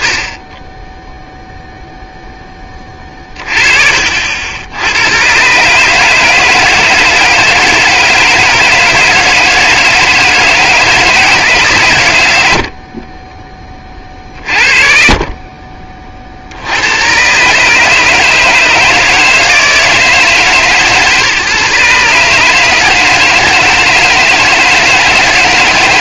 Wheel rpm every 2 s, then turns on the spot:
10, 10, 80, 160, 160, 160, 70, 40, 80, 160, 150, 150, 160.
none